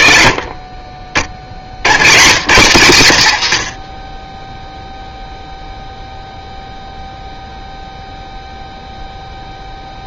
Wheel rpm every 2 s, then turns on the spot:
40, 110, 0, 0, 0.
none